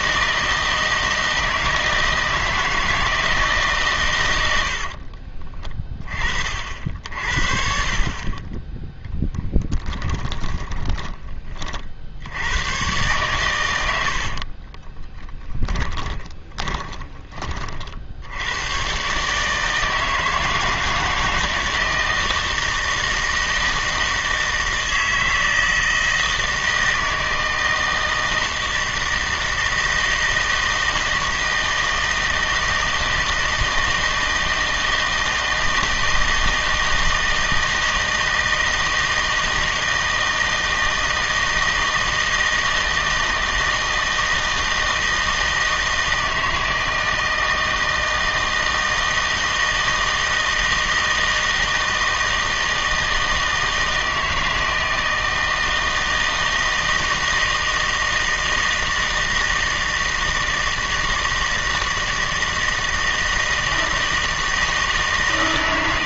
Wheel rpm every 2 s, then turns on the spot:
160, 160, 60, 60, 10, 20, 110, 30, 30, 120, 160, 160, 160, 160, 160, 160, 160, 160, 160, 160, 160, 160, 160, 160, 160, 160, 160, 160, 160, 160, 160, 160, 160.
10-12 14-18